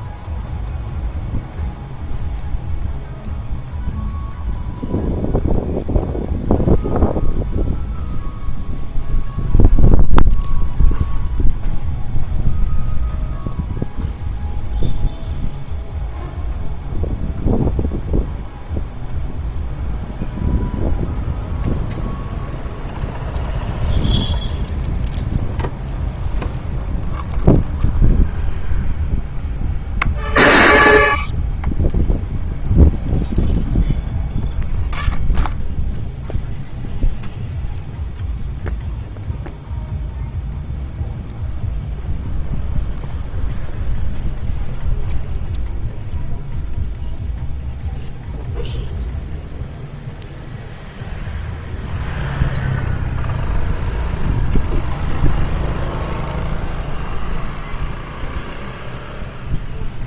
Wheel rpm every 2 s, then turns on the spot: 0, 0, 0, 0, 0, 0, 0, 0, 0, 0, 0, 0, 0, 0, 0, 0, 0, 0, 0, 0, 0, 0, 0, 0, 0, 0, 0, 0, 0, 0.
none